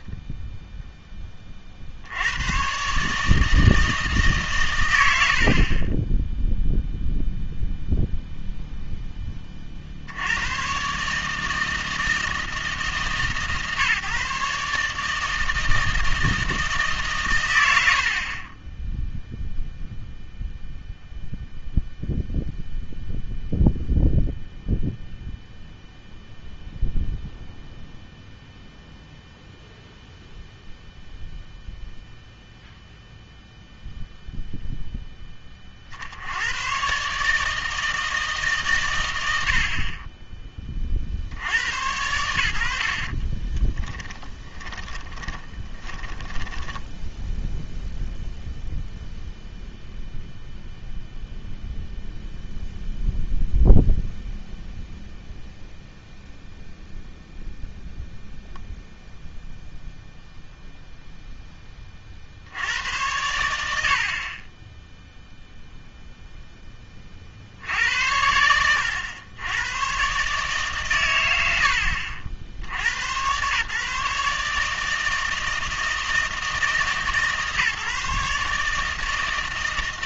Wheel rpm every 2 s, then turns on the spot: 0, 120, 100, 0, 0, 110, 160, 150, 160, 20, 0, 0, 0, 0, 0, 0, 0, 0, 100, 140, 20, 80, 20, 10, 0, 0, 0, 0, 0, 0, 0, 80, 20, 10, 90, 140, 70, 150, 160, 150.
44-48